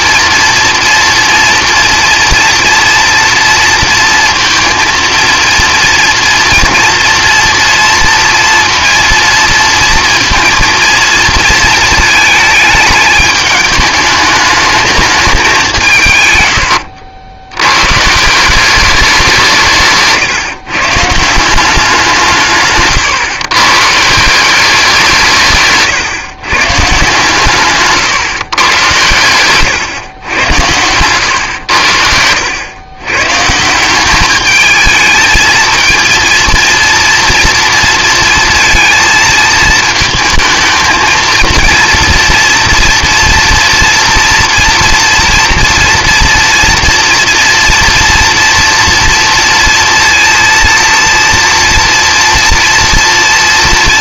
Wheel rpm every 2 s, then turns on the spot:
230, 230, 230, 230, 230, 230, 220, 210, 100, 190, 150, 140, 190, 130, 130, 100, 100, 210, 230, 230, 220, 240, 230, 230, 230, 230, 230.
16-18